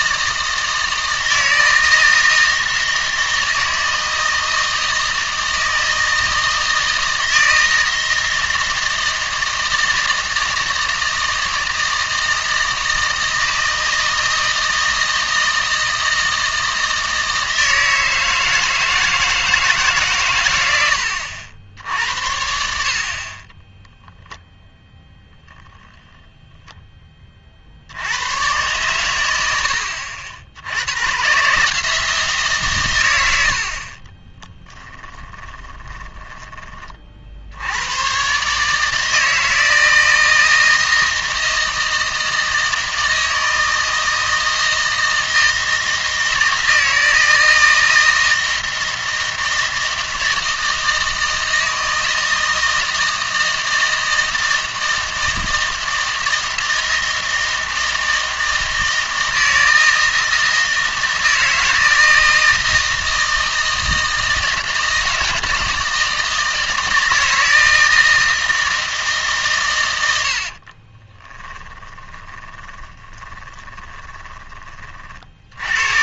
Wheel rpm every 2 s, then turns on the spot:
160, 160, 160, 160, 160, 160, 160, 160, 160, 160, 90, 60, 0, 10, 120, 110, 140, 10, 30, 150, 160, 160, 160, 160, 160, 160, 160, 160, 160, 160, 160, 160, 160, 160, 160, 40, 20, 40.
34-36 70-74